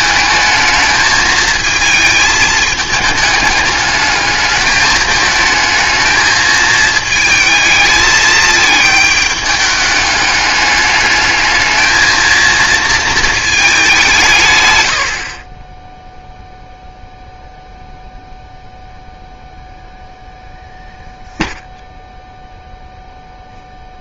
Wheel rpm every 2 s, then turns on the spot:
220, 220, 220, 220, 220, 210, 230, 130, 0, 0, 0, 0.
none